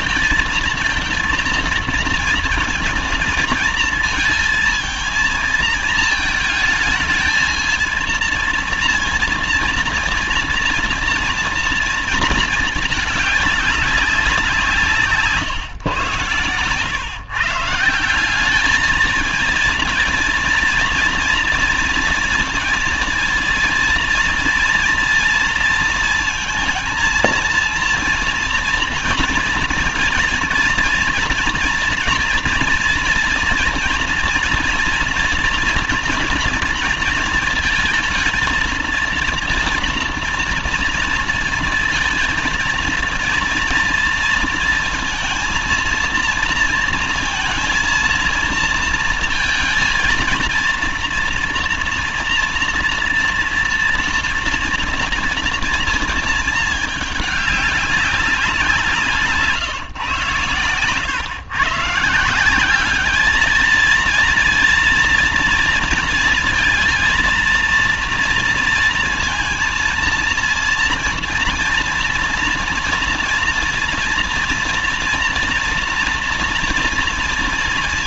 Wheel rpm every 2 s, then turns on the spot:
230, 230, 220, 220, 230, 230, 220, 170, 120, 200, 230, 230, 230, 230, 230, 240, 240, 230, 230, 230, 230, 230, 230, 230, 230, 230, 230, 230, 220, 180, 130, 190, 230, 230, 230, 230, 230, 230, 230.
none